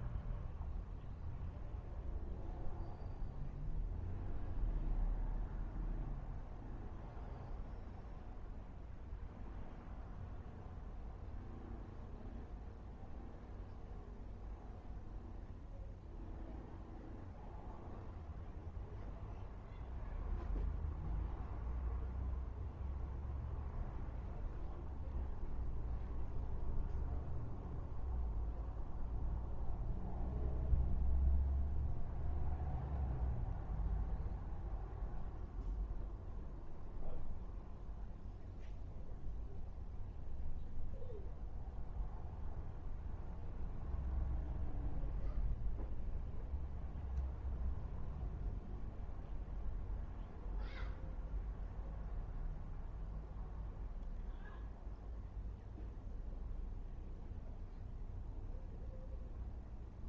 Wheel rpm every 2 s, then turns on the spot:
0, 0, 0, 0, 0, 0, 0, 0, 0, 0, 0, 0, 0, 0, 0, 0, 0, 0, 0, 0, 0, 0, 0, 0, 0, 0, 0, 0, 0, 0.
none